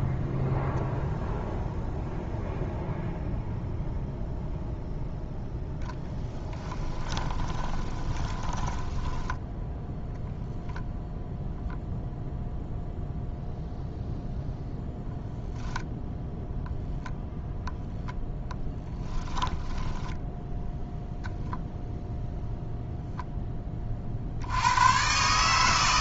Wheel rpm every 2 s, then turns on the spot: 0, 0, 0, 10, 10, 10, 0, 0, 0, 10, 0, 0, 110.
6-10 18-20